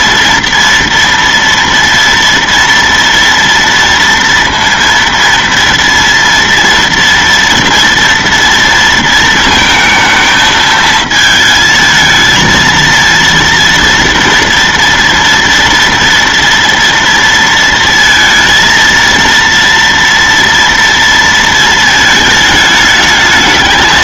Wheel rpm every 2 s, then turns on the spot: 230, 230, 230, 230, 230, 220, 230, 230, 230, 230, 230, 220.
none